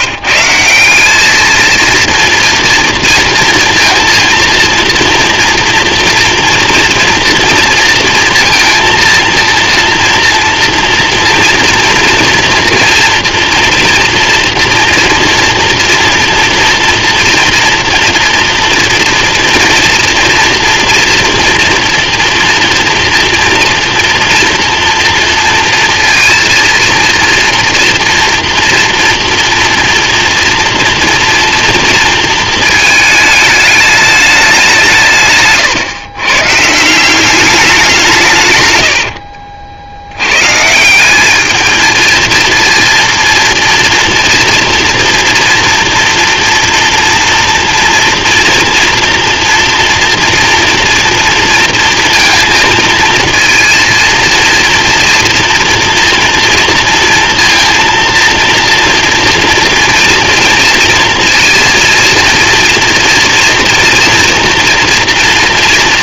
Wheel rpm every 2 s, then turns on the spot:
190, 230, 230, 230, 230, 240, 230, 230, 230, 230, 230, 240, 240, 230, 230, 230, 220, 180, 160, 90, 160, 230, 230, 230, 240, 230, 230, 230, 230, 230, 230, 230, 230.
38-40